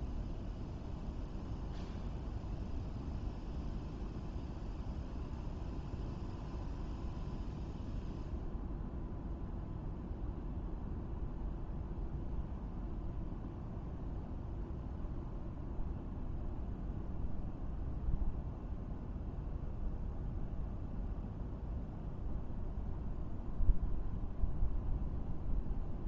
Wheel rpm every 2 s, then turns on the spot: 0, 0, 0, 0, 0, 0, 0, 0, 0, 0, 0, 0, 0.
none